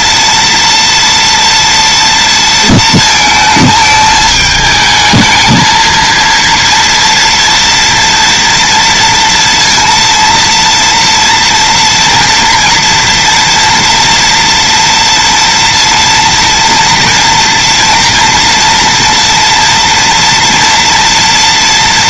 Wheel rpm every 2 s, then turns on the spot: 230, 230, 220, 230, 230, 230, 230, 240, 230, 230, 230.
none